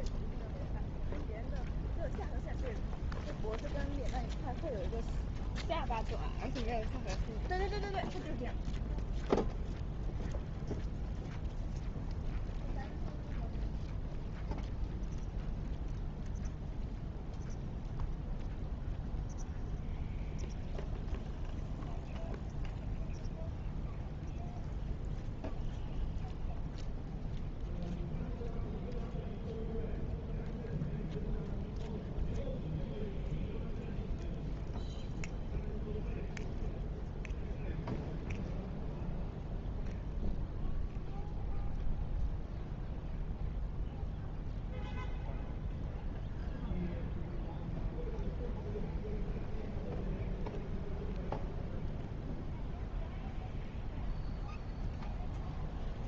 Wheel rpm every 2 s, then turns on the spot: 0, 0, 0, 0, 0, 0, 0, 0, 0, 0, 0, 0, 0, 0, 0, 0, 0, 0, 0, 0, 0, 0, 0, 0, 0, 0, 0, 0.
none